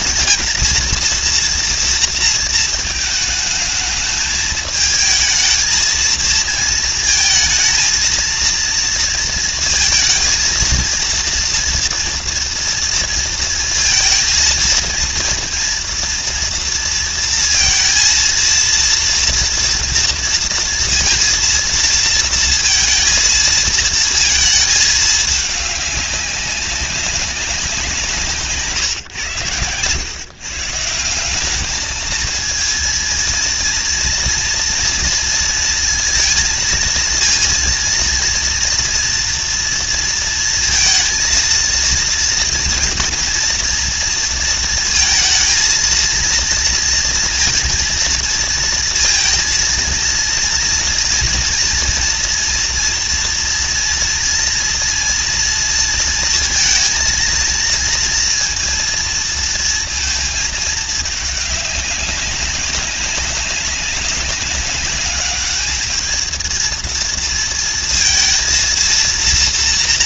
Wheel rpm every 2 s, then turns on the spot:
230, 220, 220, 220, 230, 230, 230, 230, 230, 230, 230, 230, 220, 190, 130, 180, 230, 230, 230, 230, 220, 230, 230, 230, 230, 230, 230, 230, 230, 230, 210, 190, 210, 230, 230.
none